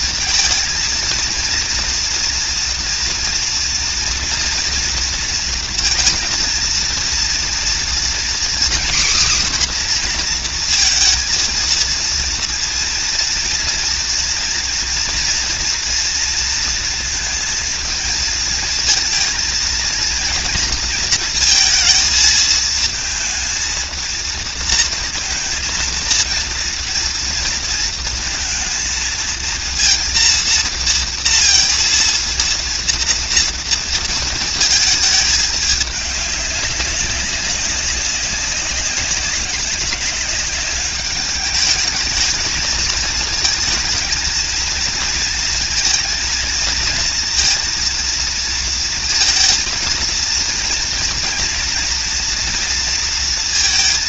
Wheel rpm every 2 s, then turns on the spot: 230, 230, 230, 230, 250, 240, 230, 230, 230, 230, 230, 230, 230, 230, 230, 230, 230, 220, 200, 190, 200, 220, 230, 230, 230, 230, 230.
none